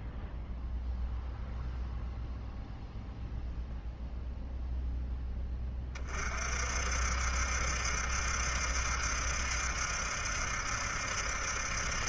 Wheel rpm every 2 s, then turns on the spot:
0, 0, 10, 60, 70, 70.
none